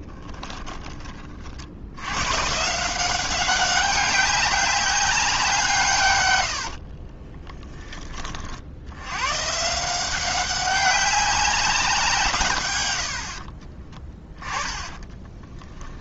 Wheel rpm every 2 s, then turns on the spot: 20, 160, 200, 60, 80, 200, 110, 20.
6-8 14-16